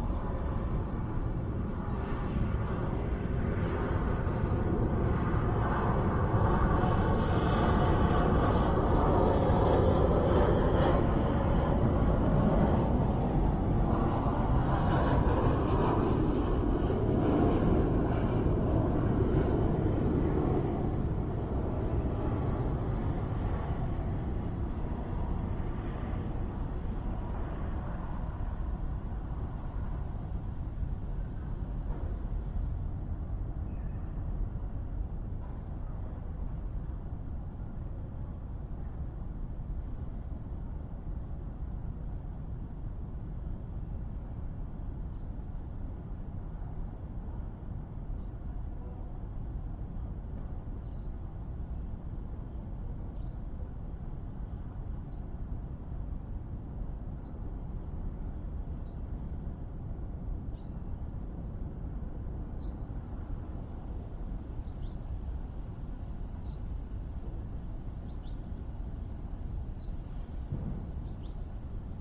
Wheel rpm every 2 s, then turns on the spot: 0, 0, 0, 0, 0, 0, 0, 0, 0, 0, 0, 0, 0, 0, 0, 0, 0, 0, 0, 0, 0, 0, 0, 0, 0, 0, 0, 0, 0, 0, 0, 0, 0, 0, 0, 0.
none